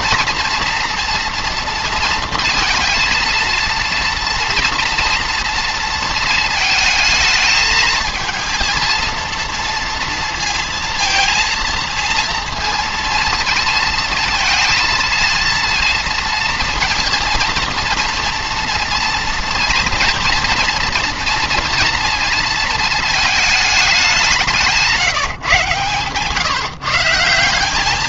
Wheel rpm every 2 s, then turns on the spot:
230, 220, 230, 220, 230, 230, 230, 230, 230, 230, 230, 230, 170, 150.
none